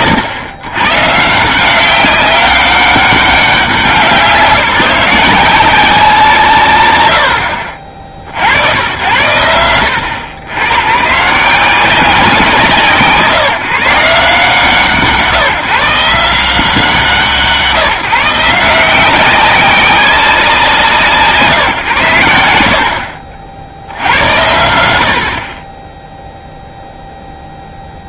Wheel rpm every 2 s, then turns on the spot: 100, 200, 180, 110, 100, 120, 160, 160, 160, 180, 150, 60, 90, 0.
none